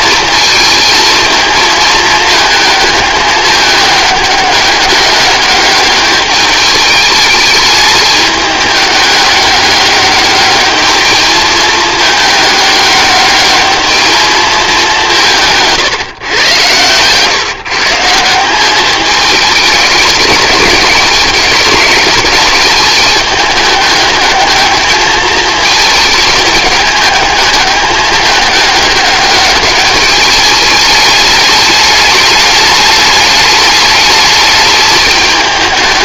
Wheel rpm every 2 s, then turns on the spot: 220, 210, 200, 210, 210, 210, 210, 200, 120, 200, 200, 210, 210, 220, 210, 210, 210, 210.
none